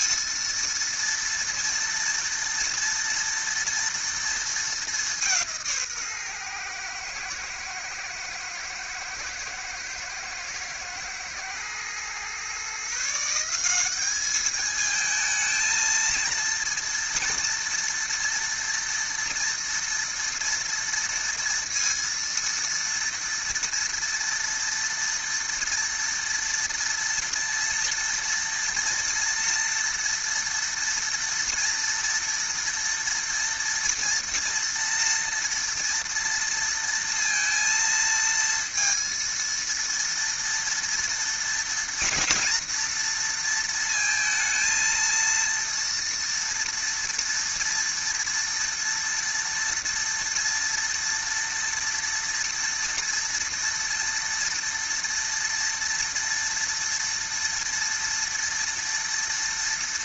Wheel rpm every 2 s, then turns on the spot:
230, 230, 220, 120, 110, 110, 130, 210, 230, 230, 230, 230, 230, 230, 230, 230, 230, 230, 230, 230, 230, 230, 230, 230, 230, 230, 230, 230, 230, 230.
none